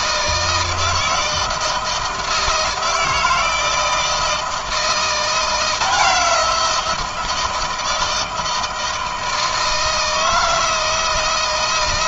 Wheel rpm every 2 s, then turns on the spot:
160, 160, 160, 170, 160, 160.
none